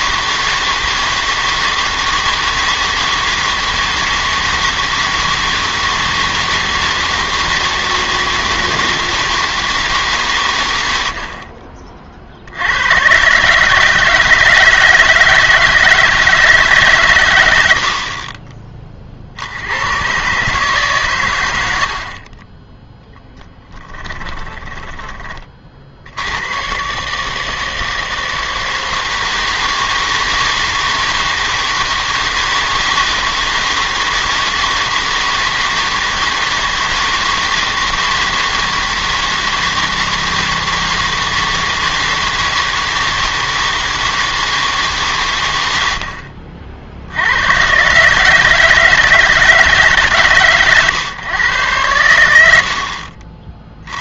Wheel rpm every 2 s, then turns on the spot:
160, 160, 160, 160, 160, 110, 90, 160, 160, 30, 140, 20, 20, 120, 160, 160, 170, 160, 160, 160, 160, 160, 160, 50, 160, 130, 70.
24-26